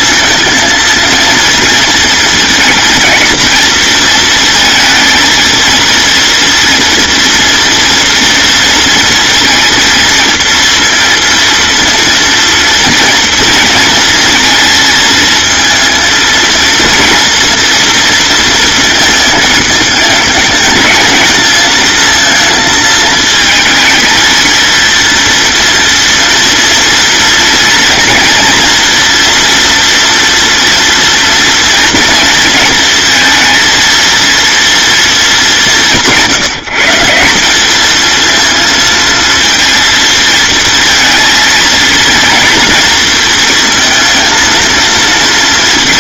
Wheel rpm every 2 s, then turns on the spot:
230, 230, 220, 230, 230, 230, 230, 220, 230, 230, 220, 220, 230, 230, 240, 230, 230, 230, 170, 230, 230, 230, 230.
none